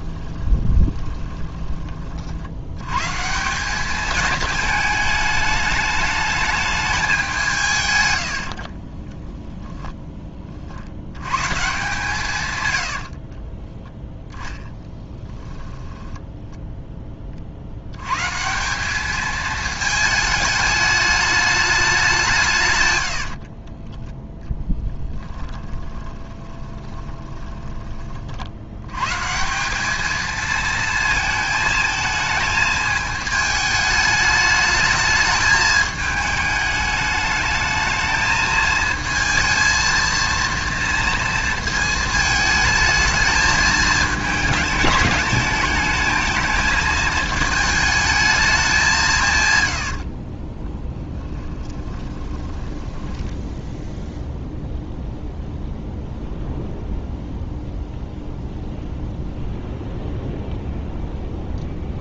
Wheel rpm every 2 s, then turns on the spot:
20, 120, 220, 210, 30, 80, 90, 10, 10, 190, 210, 100, 10, 20, 110, 230, 220, 210, 210, 220, 230, 220, 210, 220, 190, 20, 10, 0, 0, 0, 0.
0-2 8-10 12-16 22-28 50-54